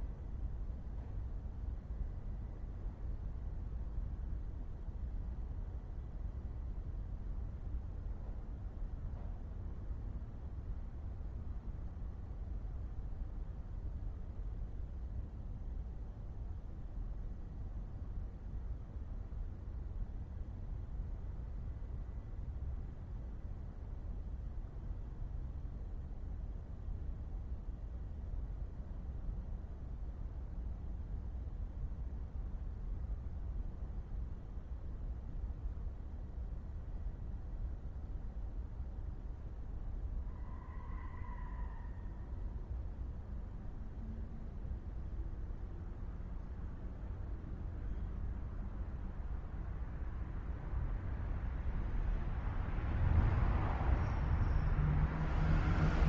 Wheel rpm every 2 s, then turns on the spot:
0, 0, 0, 0, 0, 0, 0, 0, 0, 0, 0, 0, 0, 0, 0, 0, 0, 0, 0, 0, 0, 0, 0, 0, 0, 0, 0, 0.
none